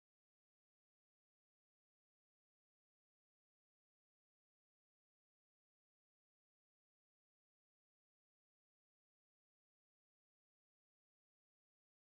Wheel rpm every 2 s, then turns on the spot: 0, 0, 0, 0, 0, 0.
none